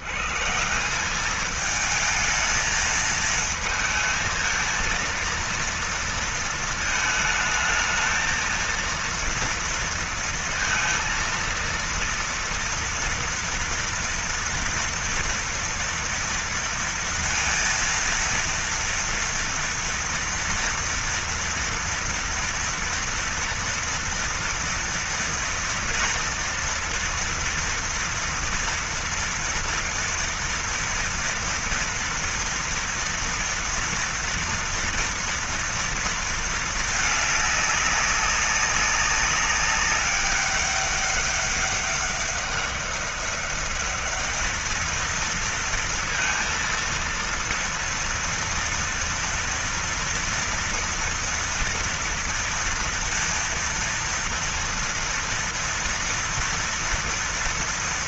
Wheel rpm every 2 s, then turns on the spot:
110, 220, 230, 230, 220, 230, 230, 230, 230, 230, 230, 230, 230, 230, 240, 230, 230, 240, 230, 200, 200, 200, 210, 230, 230, 230, 230, 230, 230.
none